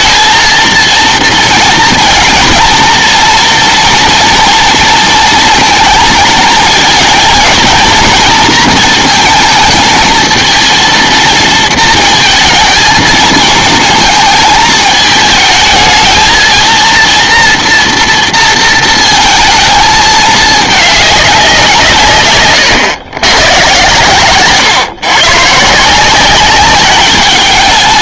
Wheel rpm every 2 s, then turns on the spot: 230, 230, 230, 230, 230, 230, 230, 220, 230, 230, 210, 120, 130, 200.
none